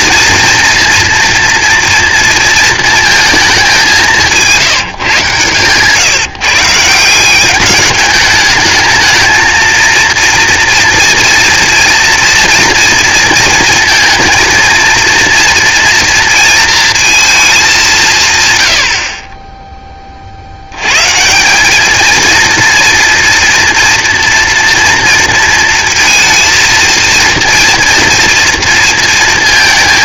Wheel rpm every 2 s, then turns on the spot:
230, 230, 180, 140, 210, 230, 230, 230, 230, 130, 60, 230, 230, 230, 230.
none